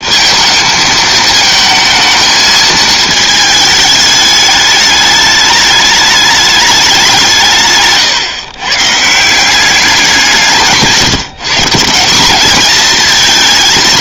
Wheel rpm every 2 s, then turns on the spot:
220, 220, 210, 190, 140, 160, 220.
none